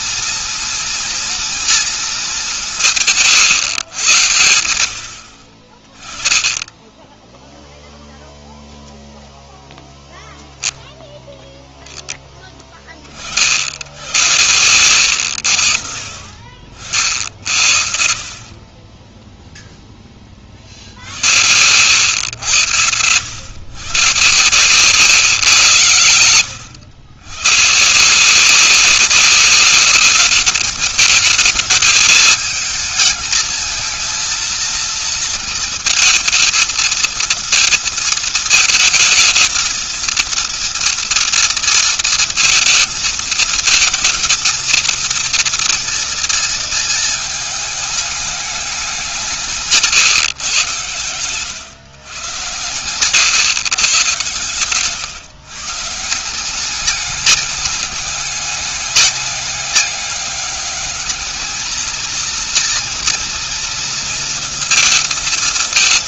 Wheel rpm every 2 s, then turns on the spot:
230, 210, 110, 20, 0, 0, 10, 90, 50, 30, 30, 100, 130, 110, 170, 210, 220, 230, 230, 220, 230, 230, 220, 230, 210, 140, 120, 140, 170, 200, 200, 230, 230.
none